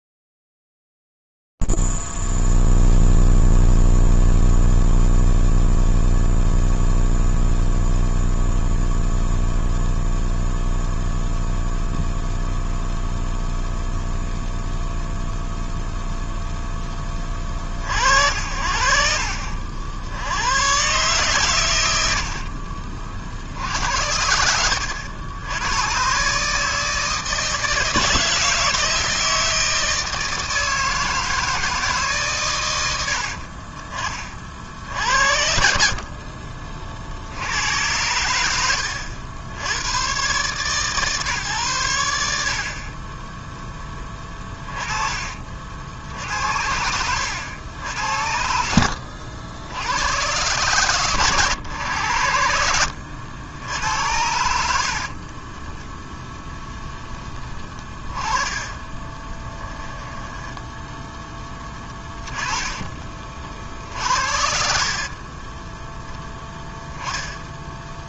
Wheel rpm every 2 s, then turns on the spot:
0, 0, 0, 0, 0, 0, 0, 0, 0, 60, 80, 70, 80, 140, 160, 160, 120, 40, 40, 90, 130, 60, 20, 70, 70, 120, 80, 80, 0, 20, 10, 30, 70, 0.
22-24 36-38 48-50 54-56 58-60 62-64